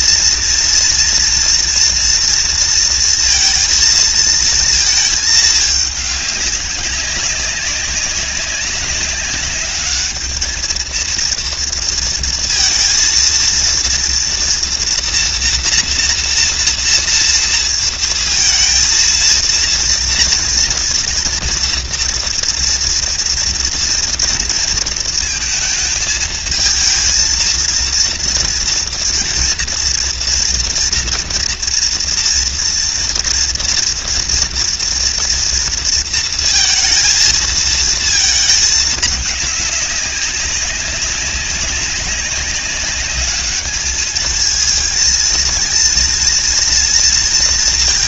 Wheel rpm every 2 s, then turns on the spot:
230, 230, 220, 190, 200, 230, 230, 240, 230, 230, 230, 240, 220, 230, 230, 230, 230, 230, 230, 210, 200, 200, 230, 230.
none